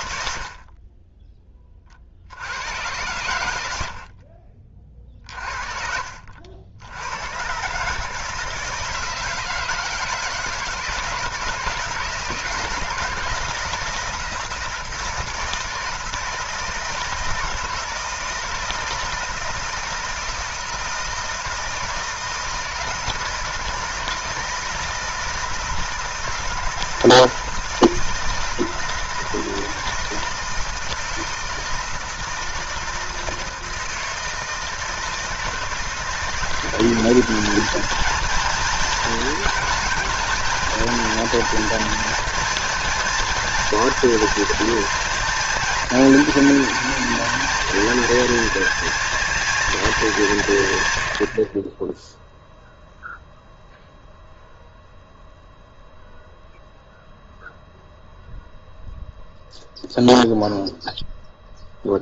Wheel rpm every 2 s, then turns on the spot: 50, 90, 40, 80, 160, 160, 160, 160, 160, 160, 160, 160, 160, 160, 160, 160, 160, 160, 180, 220, 230, 230, 230, 220, 230, 130, 0, 0, 0, 0, 0.
4-6